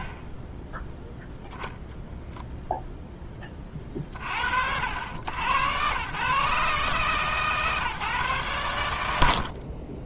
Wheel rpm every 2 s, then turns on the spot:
10, 0, 80, 140, 110.
none